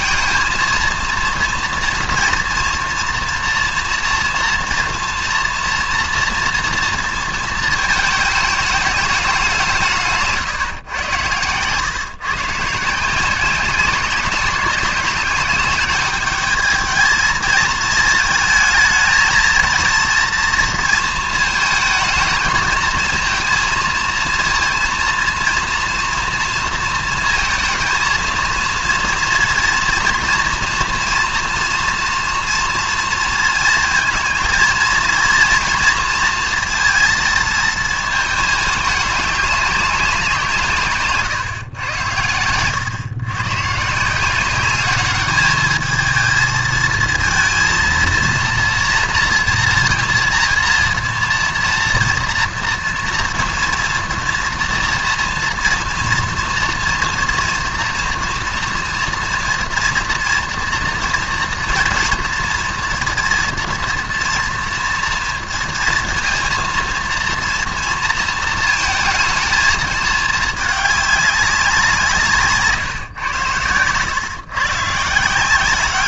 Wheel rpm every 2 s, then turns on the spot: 230, 230, 240, 230, 210, 140, 140, 190, 210, 220, 230, 220, 230, 230, 230, 230, 230, 230, 230, 210, 170, 100, 190, 220, 230, 230, 230, 230, 230, 230, 230, 230, 230, 230, 230, 220, 150, 130.
none